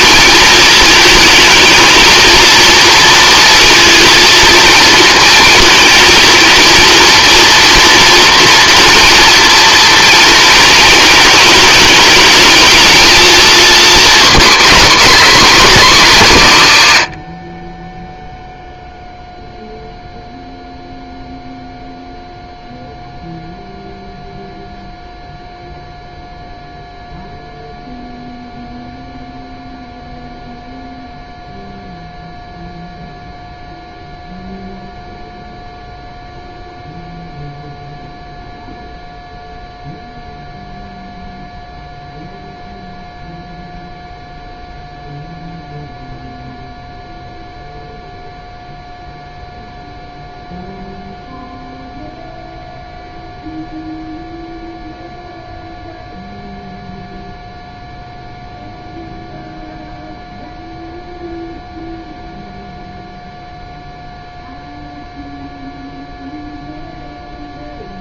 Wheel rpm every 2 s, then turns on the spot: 220, 230, 230, 230, 230, 220, 220, 200, 120, 0, 0, 0, 0, 0, 0, 0, 0, 0, 0, 0, 0, 0, 0, 0, 0, 0, 0, 0, 0, 0, 0, 0, 0, 0.
none